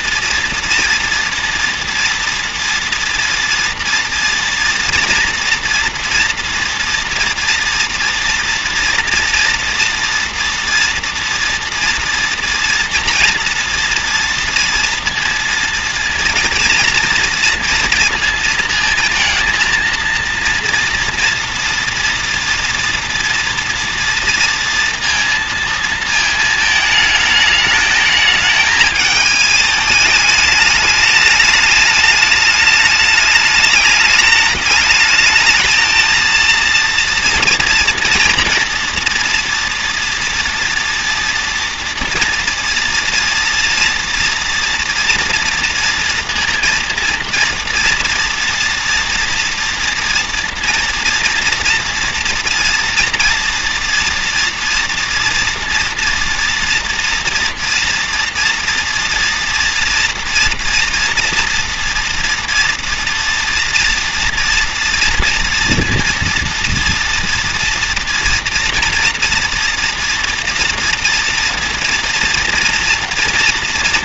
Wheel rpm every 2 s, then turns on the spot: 230, 230, 230, 240, 240, 240, 230, 230, 240, 230, 230, 230, 230, 220, 220, 210, 210, 210, 230, 240, 230, 230, 230, 230, 230, 230, 230, 230, 230, 230, 230, 230, 230, 230, 230, 230, 240.
none